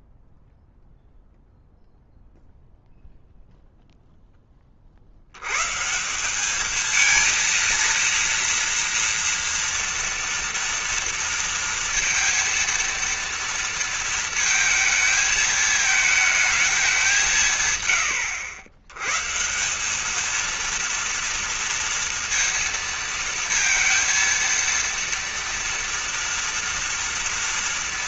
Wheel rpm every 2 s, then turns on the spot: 0, 0, 10, 180, 230, 230, 230, 230, 220, 100, 210, 230, 230, 230.
none